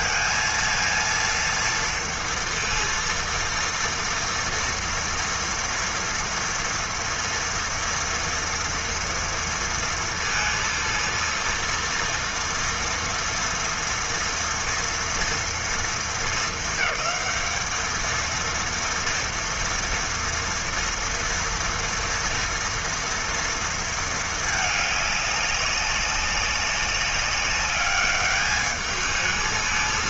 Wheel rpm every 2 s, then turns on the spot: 230, 230, 230, 230, 230, 230, 230, 240, 230, 230, 230, 230, 220, 190, 210.
none